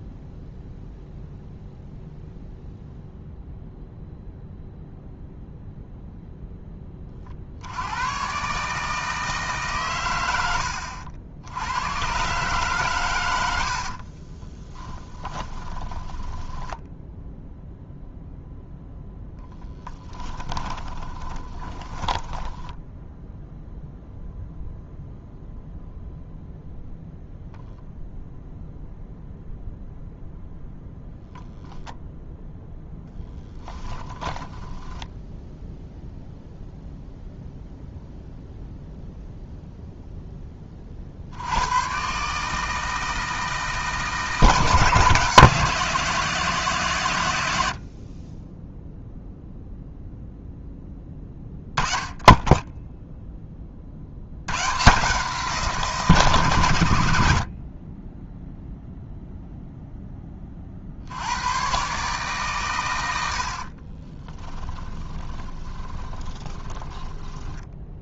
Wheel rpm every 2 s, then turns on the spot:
0, 0, 0, 10, 150, 70, 130, 20, 10, 0, 20, 10, 0, 0, 0, 0, 0, 10, 0, 0, 30, 160, 160, 160, 10, 10, 10, 130, 100, 0, 40, 120, 10, 10.
14-18 20-24 34-36 64-68